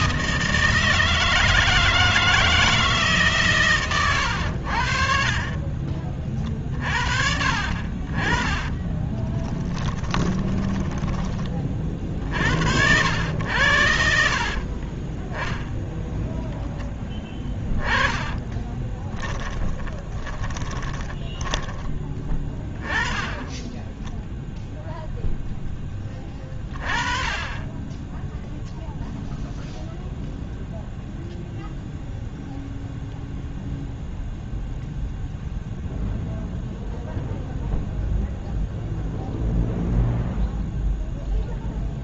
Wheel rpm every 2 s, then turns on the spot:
160, 160, 90, 40, 20, 20, 60, 40, 10, 20, 20, 10, 0, 20, 0, 0, 0, 0, 0, 0, 0.
8-12 18-22